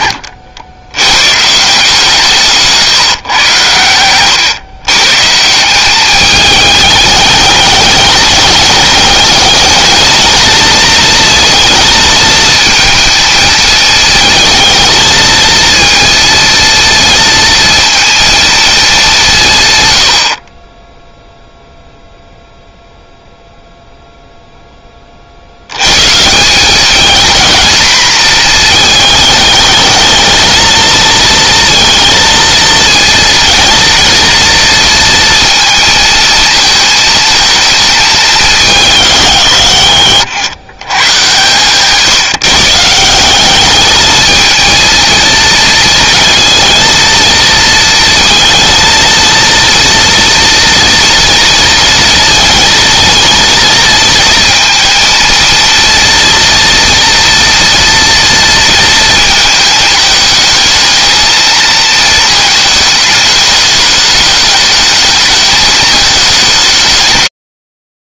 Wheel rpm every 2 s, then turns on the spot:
100, 140, 130, 210, 210, 230, 230, 230, 230, 200, 20, 0, 30, 210, 220, 230, 230, 230, 220, 170, 110, 160, 230, 230, 230, 230, 230, 230, 230, 230, 220, 210, 210, 120.
none